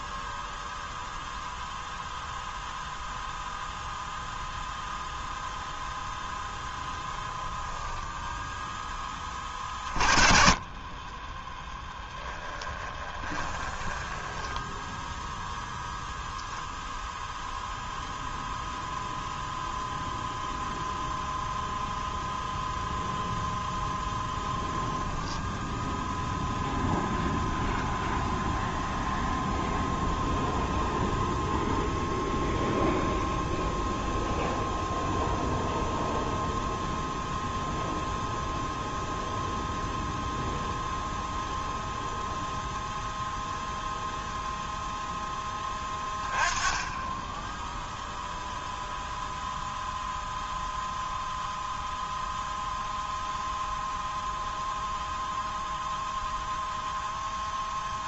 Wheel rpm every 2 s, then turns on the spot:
0, 0, 0, 0, 10, 20, 10, 10, 0, 0, 0, 0, 0, 0, 0, 0, 0, 0, 0, 0, 0, 0, 0, 10, 0, 0, 0, 0, 0.
12-14